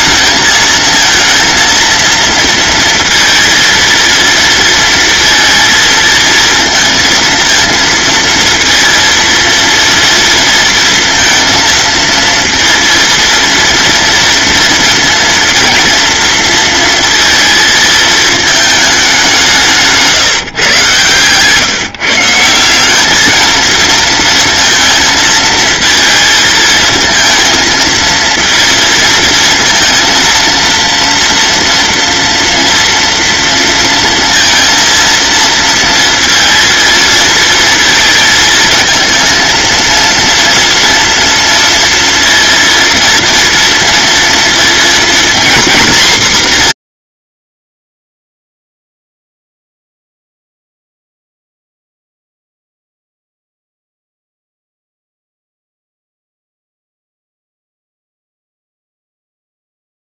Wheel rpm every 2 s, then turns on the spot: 220, 230, 230, 230, 230, 230, 230, 230, 230, 210, 130, 190, 230, 230, 230, 230, 230, 230, 230, 220, 230, 230, 230, 160, 0, 0, 0, 0, 0, 0.
none